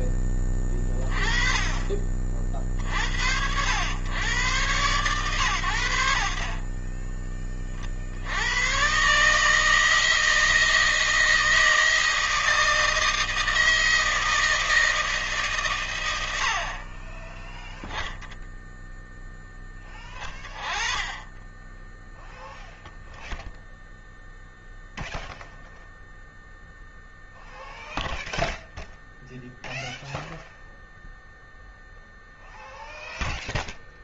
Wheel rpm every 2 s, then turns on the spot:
10, 40, 110, 40, 110, 160, 160, 160, 60, 0, 20, 0, 0, 0, 0, 0, 0.
none